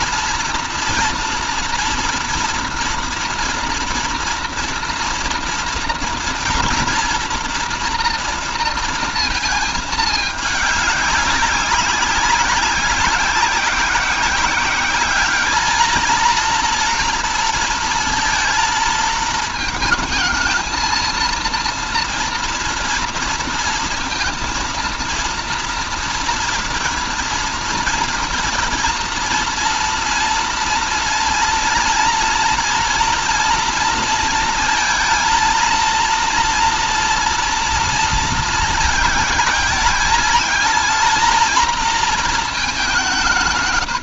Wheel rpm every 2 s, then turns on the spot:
230, 230, 230, 230, 230, 200, 190, 200, 230, 220, 220, 230, 230, 230, 230, 230, 230, 230, 230, 220, 220, 200.
none